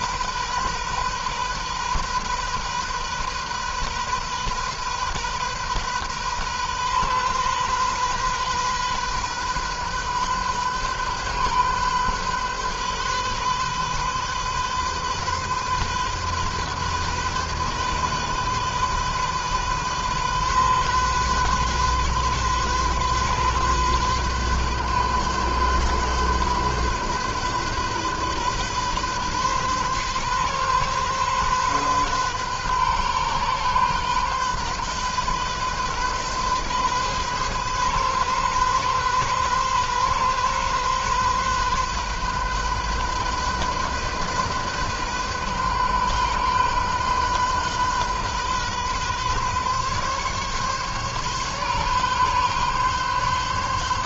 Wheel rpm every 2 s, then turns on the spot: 130, 130, 130, 130, 130, 130, 130, 130, 130, 130, 130, 130, 130, 130, 130, 130, 130, 130, 130, 130, 130, 130, 130, 130, 130, 140, 140.
none